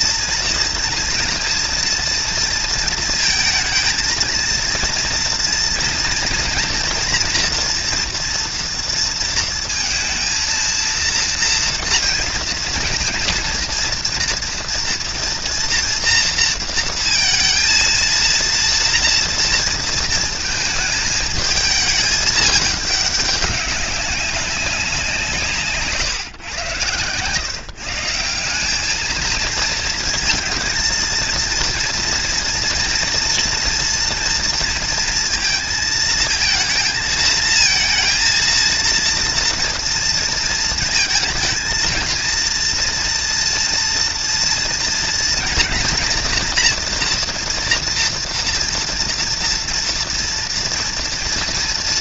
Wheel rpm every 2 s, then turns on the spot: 230, 230, 230, 240, 230, 230, 230, 230, 230, 230, 220, 210, 180, 120, 200, 230, 230, 230, 230, 230, 220, 230, 230, 230, 230, 230.
none